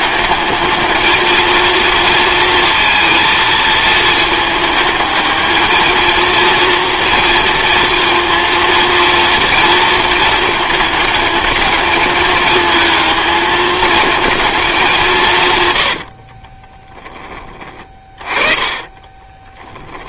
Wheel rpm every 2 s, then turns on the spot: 220, 230, 220, 230, 230, 220, 220, 200, 20, 20.
16-20